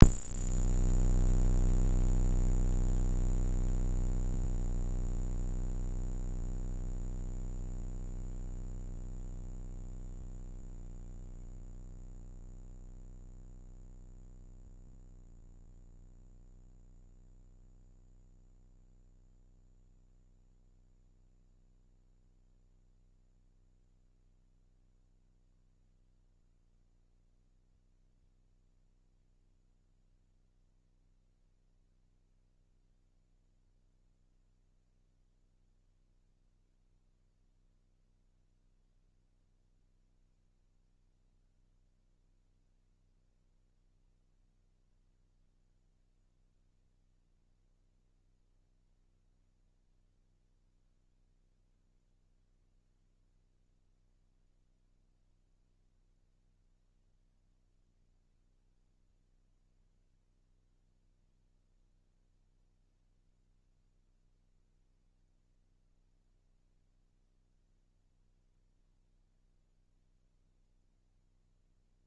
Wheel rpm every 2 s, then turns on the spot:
0, 0, 20, 110, 160, 140, 20, 0, 0, 0, 0, 0, 0, 0, 0, 0, 0, 0, 0, 0, 0, 0, 0, 0, 0, 0, 0, 0, 0, 0, 0, 0, 0, 0, 0, 0.
4-6